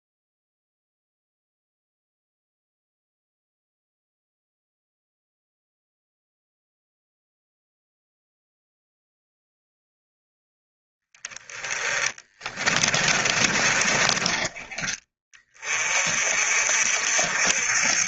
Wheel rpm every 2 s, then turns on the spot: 0, 0, 0, 0, 0, 10, 30, 30, 50.
12-14